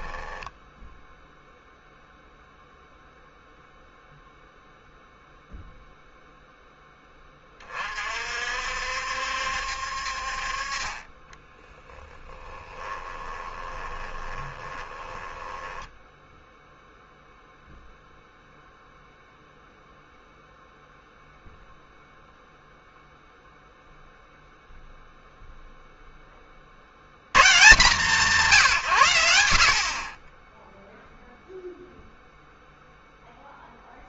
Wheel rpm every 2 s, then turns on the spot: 0, 0, 0, 10, 60, 40, 10, 20, 0, 0, 0, 0, 0, 50, 130, 10, 0.
12-16